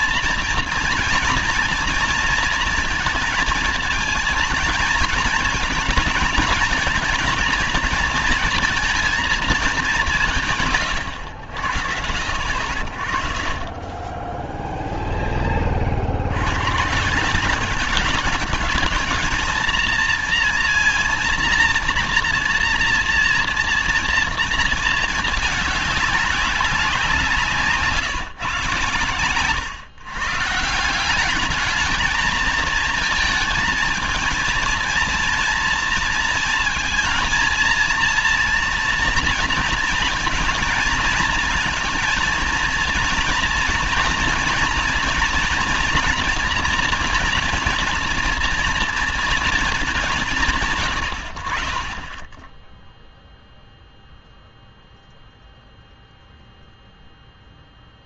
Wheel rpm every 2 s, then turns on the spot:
230, 230, 220, 220, 230, 140, 60, 10, 110, 200, 230, 230, 230, 190, 140, 160, 220, 220, 220, 230, 230, 230, 230, 230, 230, 150, 10, 0, 0.
none